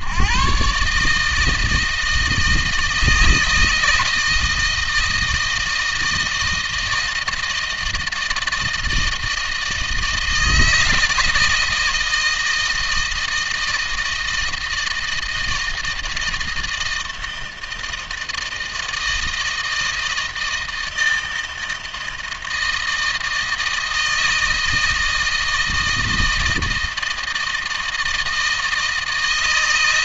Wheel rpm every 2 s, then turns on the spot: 140, 160, 160, 160, 160, 160, 160, 160, 160, 160, 160, 160, 160, 160, 160.
none